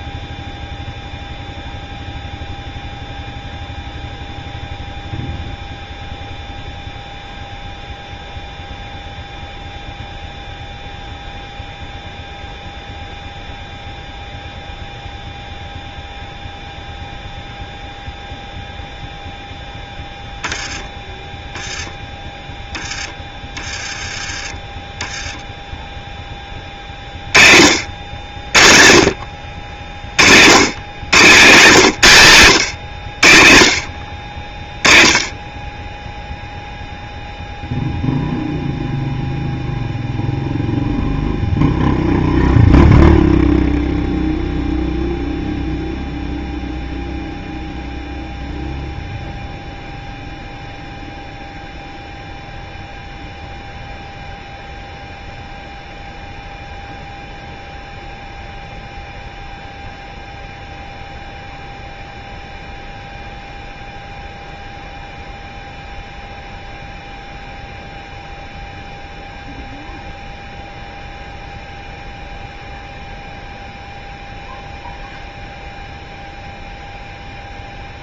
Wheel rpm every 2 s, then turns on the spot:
0, 0, 0, 0, 0, 0, 0, 0, 0, 0, 10, 10, 20, 20, 70, 100, 130, 40, 0, 0, 0, 0, 0, 0, 0, 0, 0, 0, 0, 0, 0, 0, 0, 0, 0, 0, 0, 0, 0.
none